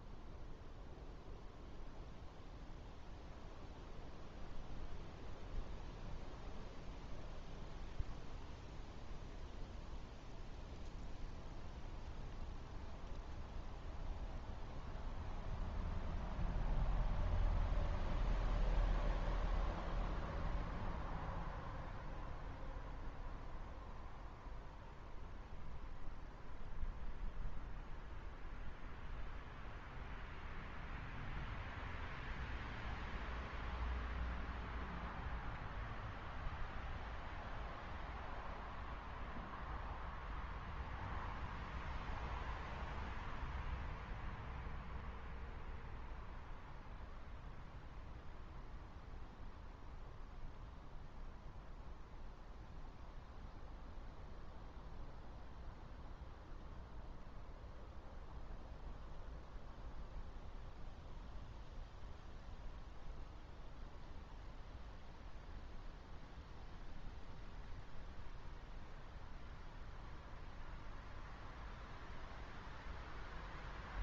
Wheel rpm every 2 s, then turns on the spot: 0, 0, 0, 0, 0, 0, 0, 0, 0, 0, 0, 0, 0, 0, 0, 0, 0, 0, 0, 0, 0, 0, 0, 0, 0, 0, 0, 0, 0, 0, 0, 0, 0, 0, 0, 0, 0.
none